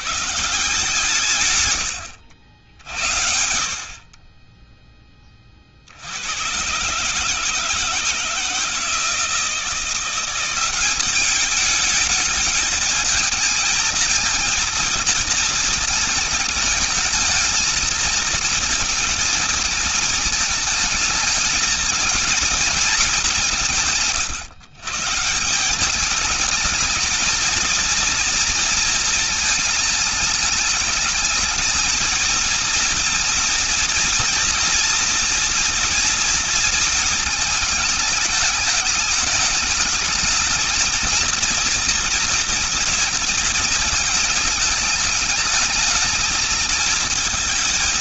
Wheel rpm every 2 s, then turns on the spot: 150, 60, 20, 120, 160, 190, 220, 230, 220, 230, 220, 230, 150, 220, 220, 210, 230, 230, 230, 210, 220, 230, 210, 220.
none